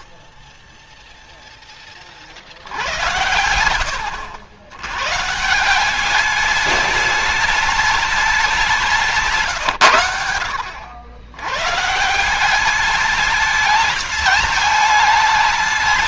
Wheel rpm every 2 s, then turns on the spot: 0, 80, 110, 210, 180, 90, 200, 210.
none